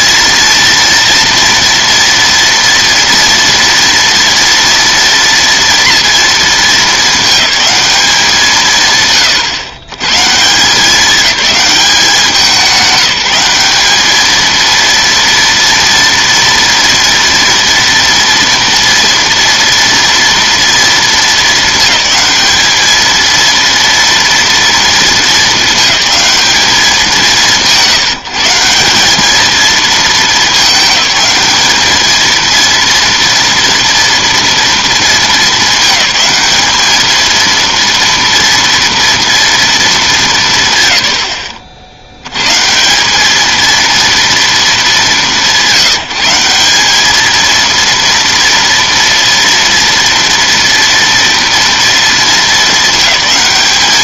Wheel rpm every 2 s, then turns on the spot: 230, 230, 230, 220, 150, 180, 190, 230, 230, 230, 230, 220, 230, 200, 180, 210, 230, 230, 210, 230, 160, 150, 220, 190, 230, 230, 220.
none